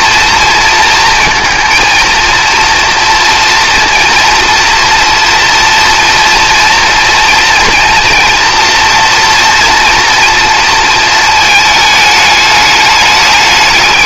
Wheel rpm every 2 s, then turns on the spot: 230, 240, 230, 230, 230, 220, 200.
none